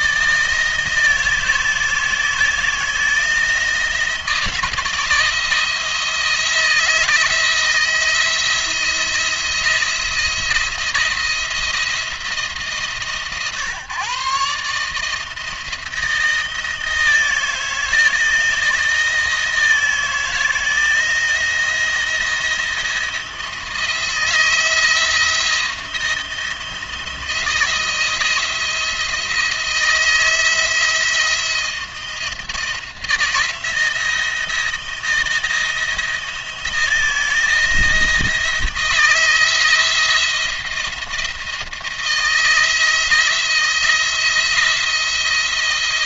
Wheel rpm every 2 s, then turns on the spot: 160, 160, 160, 160, 170, 170, 150, 150, 160, 160, 160, 160, 160, 170, 170, 170, 170, 160, 160, 160, 170, 170, 170.
none